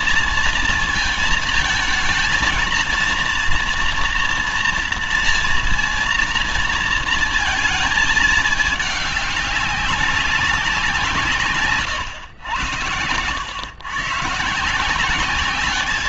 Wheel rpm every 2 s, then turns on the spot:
230, 230, 230, 230, 210, 180, 110, 170.
12-14